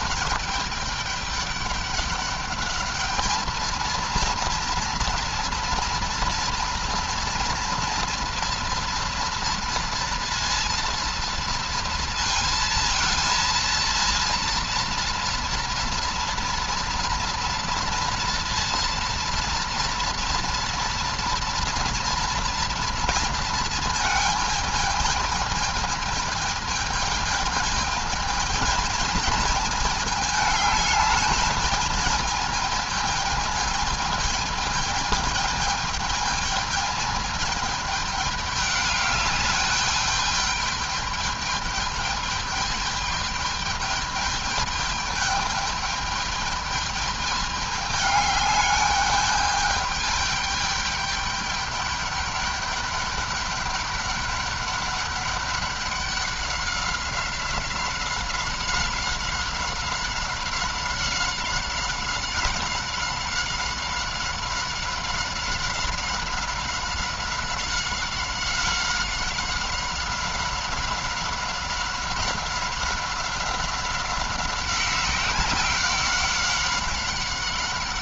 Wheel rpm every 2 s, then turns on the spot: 210, 210, 230, 230, 230, 230, 230, 230, 230, 230, 230, 230, 220, 220, 220, 210, 220, 220, 220, 210, 210, 210, 210, 210, 210, 210, 200, 200, 190, 190, 190, 190, 190, 190, 190, 190, 190, 190, 190.
none